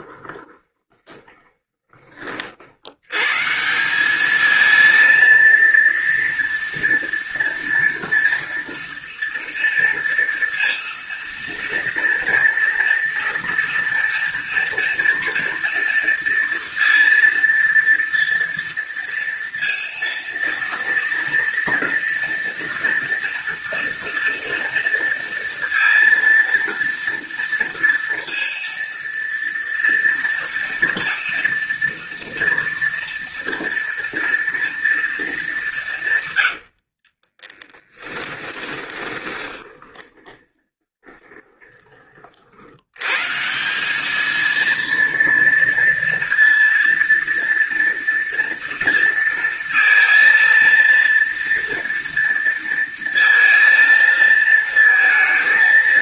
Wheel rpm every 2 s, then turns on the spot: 20, 120, 230, 230, 230, 230, 230, 230, 230, 230, 230, 240, 230, 230, 230, 230, 230, 220, 40, 20, 20, 140, 230, 230, 230, 230, 230, 230.
0-2 36-42